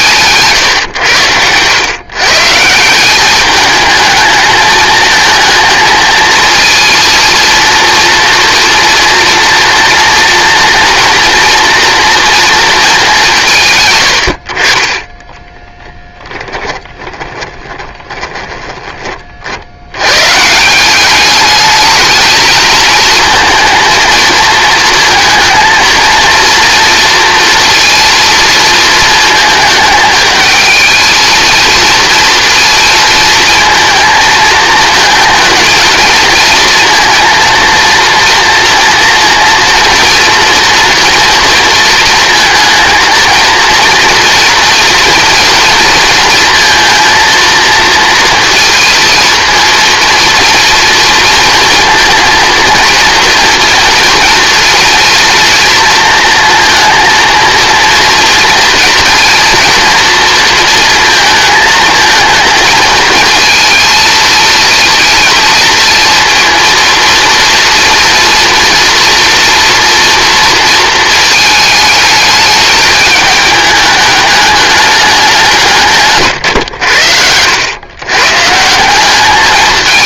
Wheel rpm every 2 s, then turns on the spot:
130, 170, 220, 230, 230, 230, 230, 40, 20, 20, 180, 220, 230, 230, 230, 220, 230, 220, 230, 230, 230, 230, 230, 230, 230, 230, 230, 230, 230, 230, 220, 220, 230, 230, 230, 230, 220, 210, 100, 170.
0-2 16-18